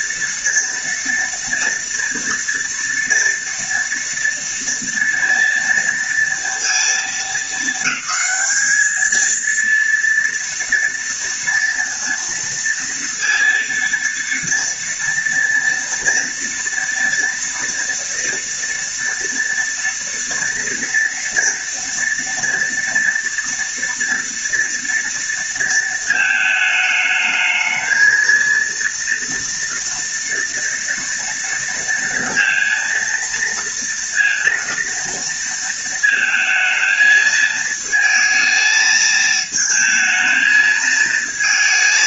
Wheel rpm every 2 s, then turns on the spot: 230, 230, 230, 230, 220, 230, 230, 230, 230, 230, 230, 230, 230, 220, 230, 230, 230, 230, 220, 220, 220.
none